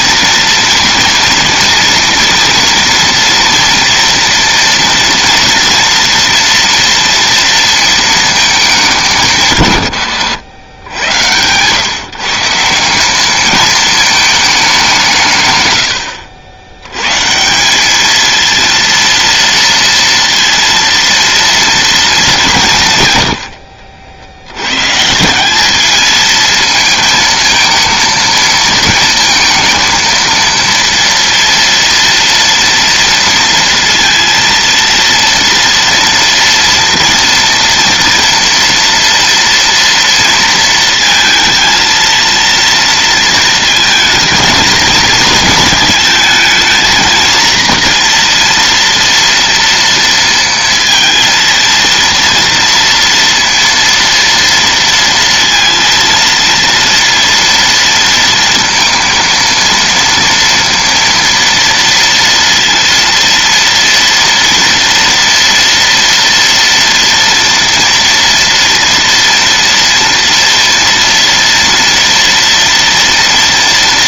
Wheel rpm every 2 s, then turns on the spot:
230, 230, 230, 230, 160, 110, 200, 150, 130, 230, 230, 110, 170, 220, 230, 230, 230, 230, 230, 230, 230, 230, 220, 230, 230, 230, 230, 230, 230, 230, 230, 230, 230, 240, 230, 230, 230.
none